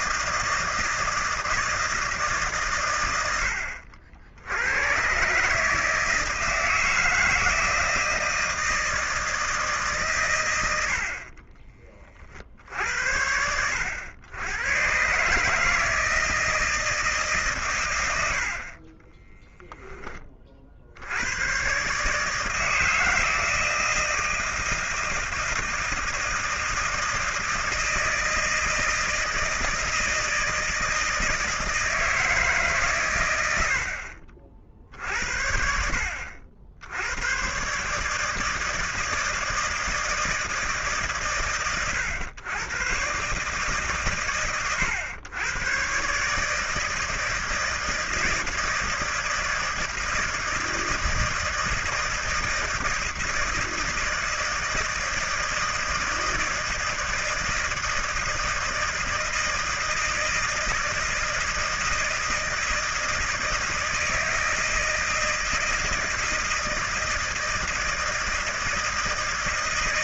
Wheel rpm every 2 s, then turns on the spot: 160, 120, 110, 160, 160, 80, 70, 120, 160, 30, 60, 160, 160, 160, 160, 160, 140, 50, 90, 160, 140, 120, 110, 160, 160, 160, 160, 160, 160, 160, 160, 160, 160, 170, 170.
none